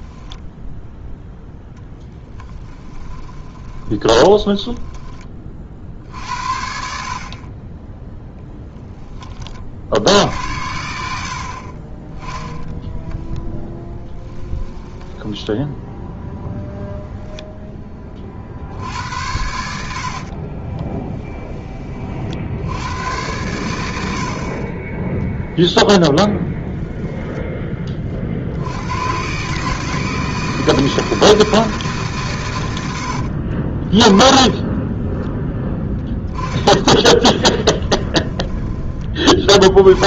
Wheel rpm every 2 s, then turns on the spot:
10, 10, 10, 60, 0, 80, 10, 10, 0, 60, 30, 80, 30, 10, 80, 160, 110, 20, 10, 20.
0-6 14-16 20-22 26-28 34-40